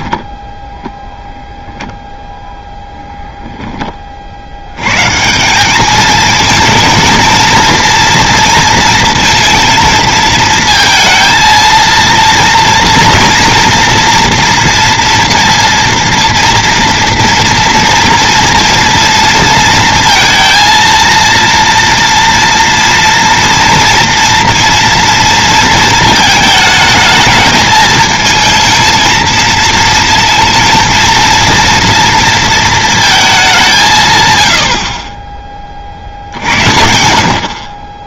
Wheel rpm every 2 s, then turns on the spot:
0, 0, 90, 220, 230, 220, 230, 230, 230, 240, 230, 230, 230, 220, 220, 230, 230, 80, 70.
none